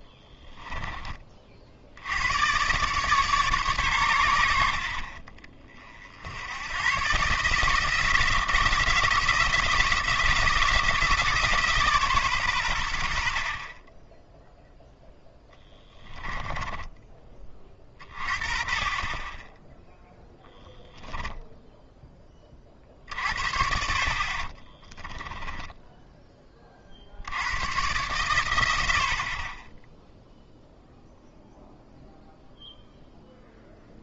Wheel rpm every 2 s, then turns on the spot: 20, 130, 50, 110, 170, 170, 90, 10, 20, 40, 10, 40, 20, 40, 70, 0, 0.
16-18 20-22 24-26